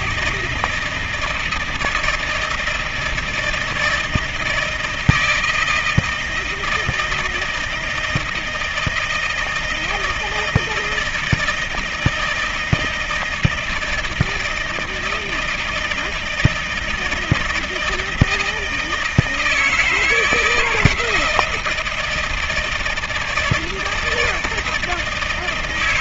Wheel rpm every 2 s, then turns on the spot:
160, 160, 160, 160, 160, 160, 160, 160, 160, 160, 160, 160, 170.
none